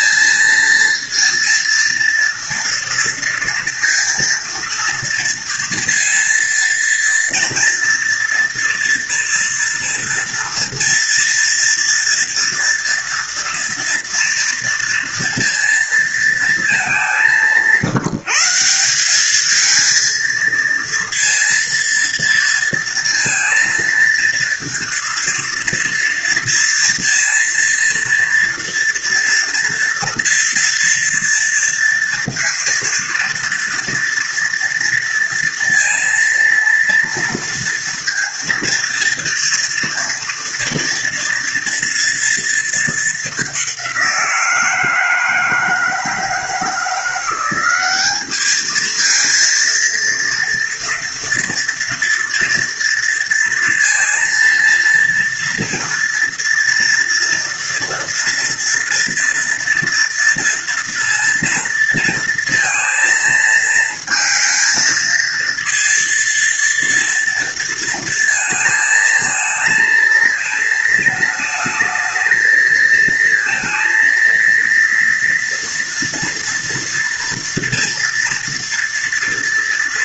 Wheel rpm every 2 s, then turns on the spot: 230, 230, 230, 230, 240, 230, 230, 230, 200, 190, 230, 230, 230, 230, 230, 230, 230, 230, 230, 230, 230, 220, 160, 170, 220, 230, 230, 230, 230, 230, 230, 230, 220, 230, 220, 220, 230, 230, 230, 230.
none